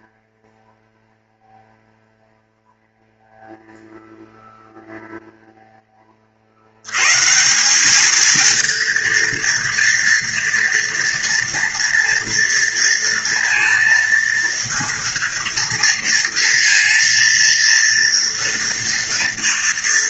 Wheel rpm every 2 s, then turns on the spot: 0, 0, 0, 50, 220, 230, 230, 230, 230, 230.
none